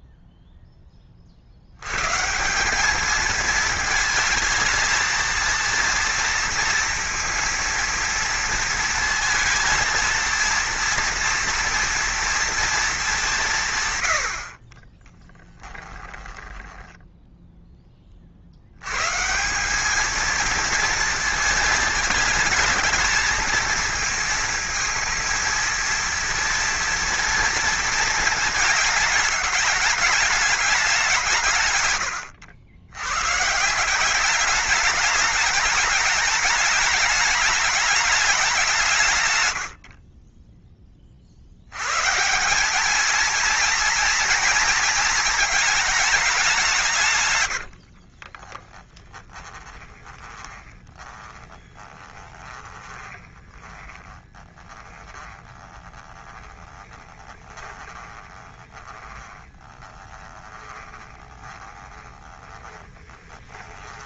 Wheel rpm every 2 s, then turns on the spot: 10, 190, 220, 230, 230, 230, 220, 40, 10, 90, 230, 220, 230, 230, 220, 200, 90, 200, 220, 170, 20, 200, 220, 180, 30, 20, 20, 20, 20, 20, 20, 30.
16-18 48-64